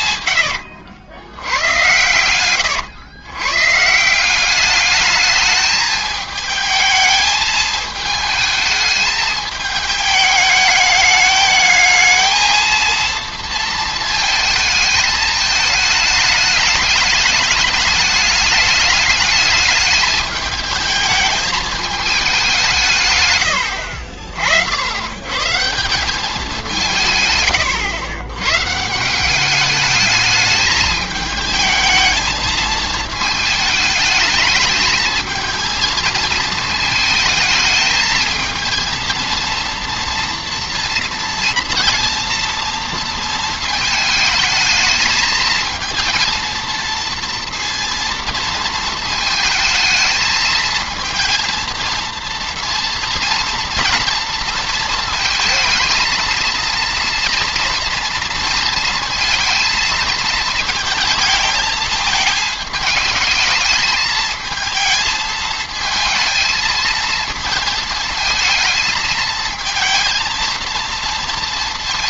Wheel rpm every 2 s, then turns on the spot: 90, 110, 200, 220, 220, 210, 220, 220, 210, 210, 220, 180, 60, 180, 140, 210, 220, 210, 220, 220, 230, 230, 220, 230, 230, 220, 230, 230, 230, 230, 230, 220, 220, 220, 220, 230.
0-2